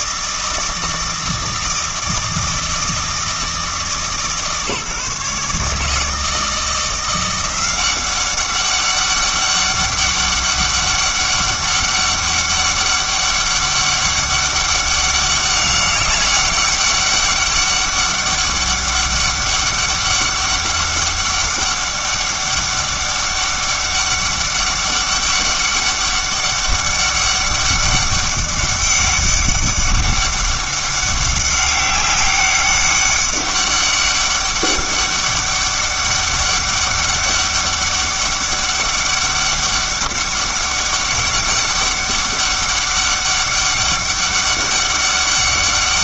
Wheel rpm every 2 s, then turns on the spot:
160, 160, 150, 160, 200, 200, 200, 200, 200, 200, 200, 200, 200, 200, 200, 200, 200, 200, 200, 200, 200, 200, 200.
none